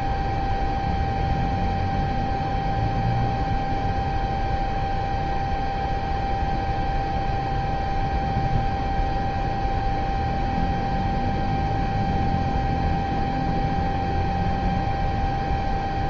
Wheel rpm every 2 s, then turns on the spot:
0, 0, 0, 0, 0, 0, 0, 0.
none